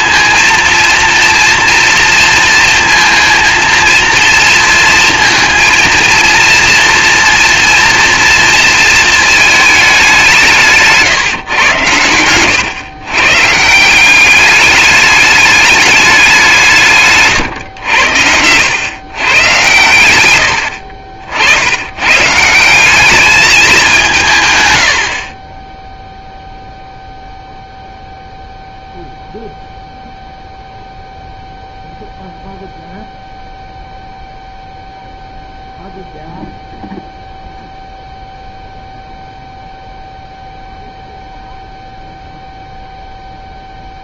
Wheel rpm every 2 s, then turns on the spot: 230, 230, 230, 230, 220, 160, 120, 200, 140, 100, 70, 200, 80, 0, 0, 0, 0, 0, 0, 0, 0, 0.
none